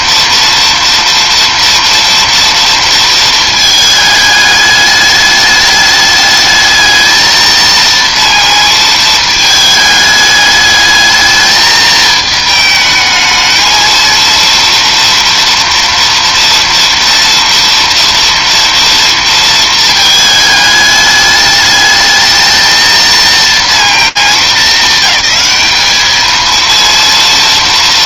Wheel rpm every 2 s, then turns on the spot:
230, 230, 210, 210, 230, 210, 220, 230, 230, 230, 220, 220, 220, 220.
none